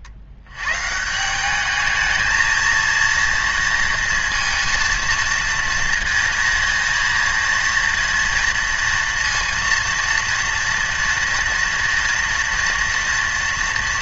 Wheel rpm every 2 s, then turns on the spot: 110, 230, 230, 230, 230, 230, 230.
none